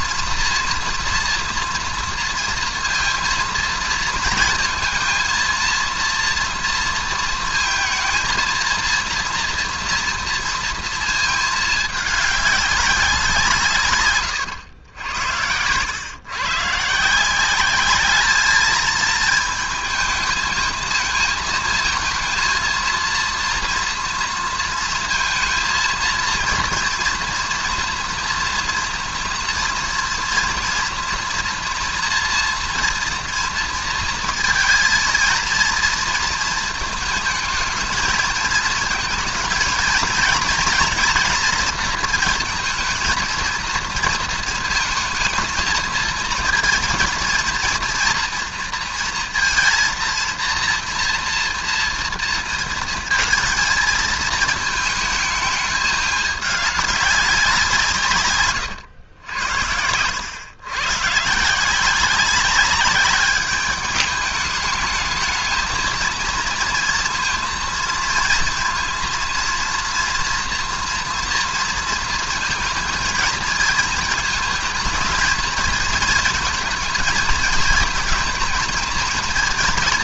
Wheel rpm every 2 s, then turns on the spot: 230, 230, 230, 230, 240, 230, 200, 100, 130, 210, 220, 220, 230, 230, 230, 240, 230, 230, 220, 220, 230, 230, 220, 230, 230, 230, 230, 220, 210, 120, 120, 200, 210, 230, 230, 240, 230, 220, 230, 220.
none